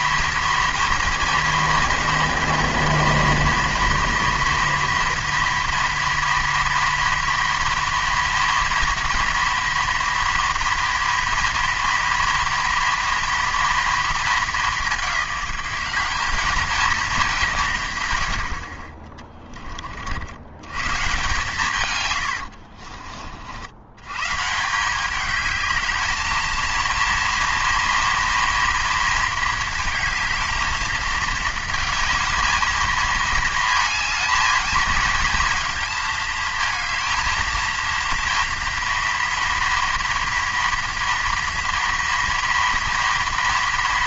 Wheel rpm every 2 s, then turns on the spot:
230, 230, 230, 230, 230, 240, 230, 210, 220, 50, 110, 60, 170, 230, 230, 220, 220, 220, 220, 230, 230, 230.
22-24